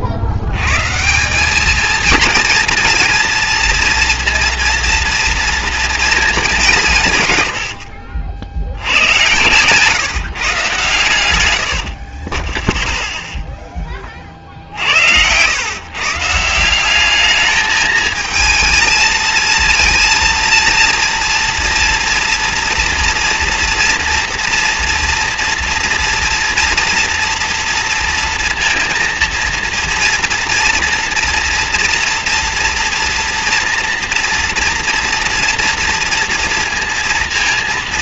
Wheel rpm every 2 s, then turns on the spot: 160, 230, 230, 140, 110, 100, 0, 100, 210, 230, 230, 230, 230, 230, 230, 240, 240, 230, 230.
10-12